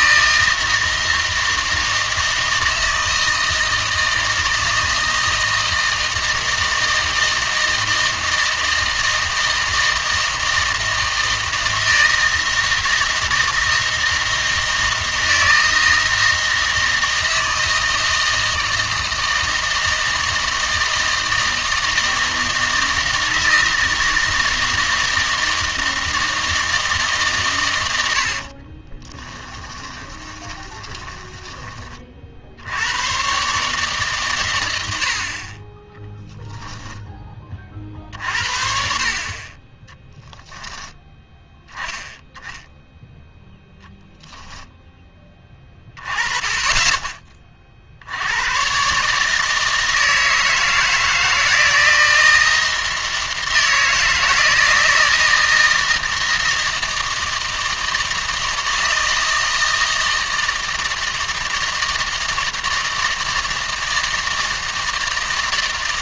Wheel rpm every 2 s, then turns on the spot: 160, 160, 160, 160, 160, 160, 160, 160, 160, 160, 160, 160, 160, 160, 30, 20, 80, 100, 0, 50, 10, 10, 10, 20, 130, 160, 170, 160, 160, 160, 160, 160, 160.
28-32